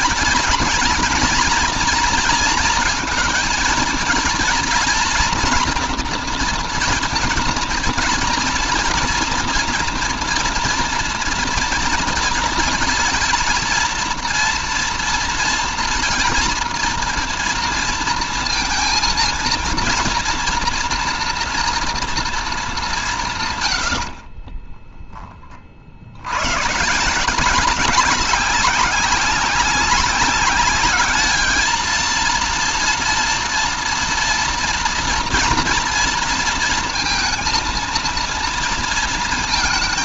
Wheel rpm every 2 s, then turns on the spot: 230, 230, 240, 240, 230, 240, 230, 240, 230, 230, 230, 230, 50, 90, 200, 200, 230, 240, 230, 230.
24-26